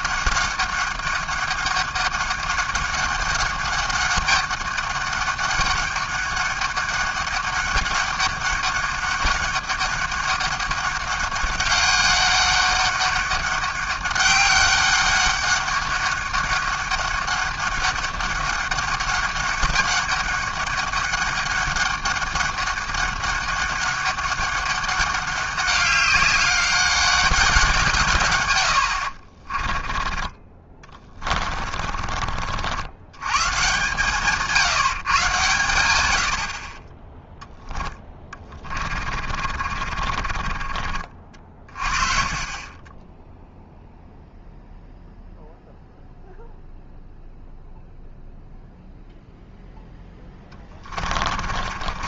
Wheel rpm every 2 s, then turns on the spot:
190, 190, 200, 200, 200, 200, 200, 200, 200, 200, 200, 200, 200, 190, 100, 20, 70, 150, 50, 30, 30, 30, 0, 0, 0, 20.
30-32 38-42 50-52